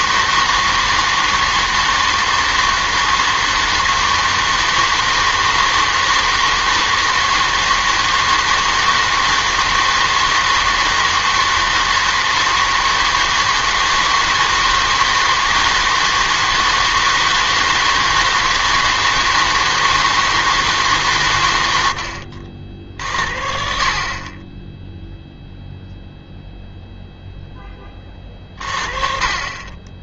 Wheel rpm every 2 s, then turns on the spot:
160, 160, 160, 160, 160, 160, 160, 160, 160, 160, 150, 50, 20, 0, 40.
none